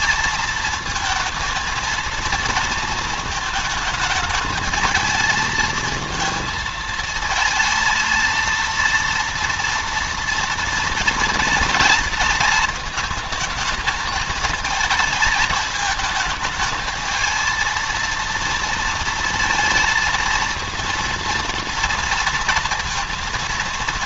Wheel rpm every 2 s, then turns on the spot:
230, 230, 220, 220, 230, 230, 220, 220, 220, 230, 230, 230.
none